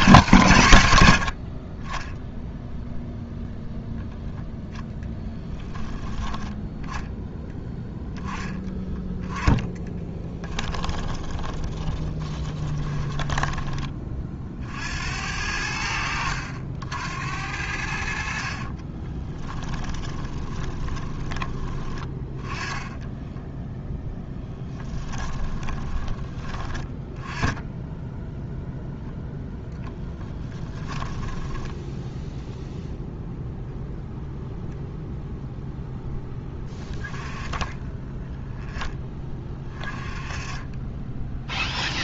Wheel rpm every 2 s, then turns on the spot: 120, 0, 0, 10, 10, 10, 20, 60, 70, 30, 30, 10, 10, 20, 10, 10, 0, 0, 10, 10, 20.
10-14 18-26 30-32